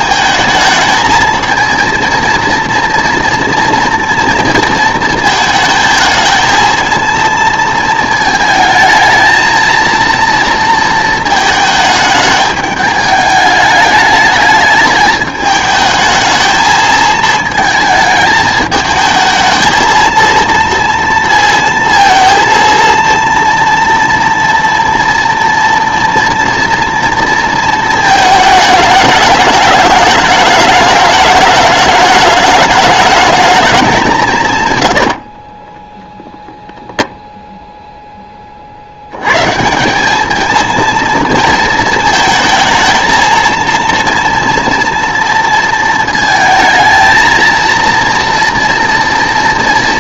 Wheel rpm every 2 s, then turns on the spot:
220, 230, 230, 220, 220, 230, 210, 210, 220, 210, 230, 230, 230, 230, 220, 210, 210, 120, 0, 50, 220, 220, 230, 230, 230.
none